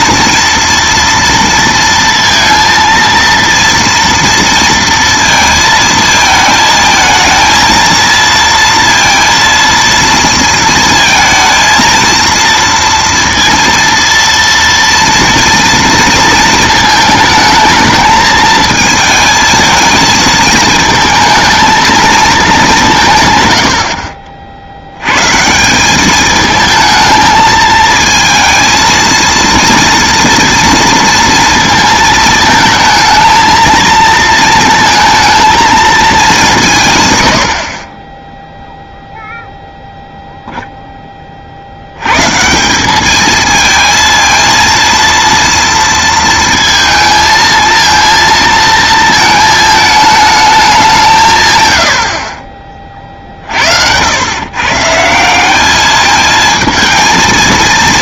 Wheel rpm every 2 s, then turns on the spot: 230, 230, 230, 220, 230, 230, 230, 230, 230, 220, 220, 210, 60, 220, 230, 230, 220, 230, 170, 0, 0, 170, 230, 230, 230, 200, 30, 140, 220.
none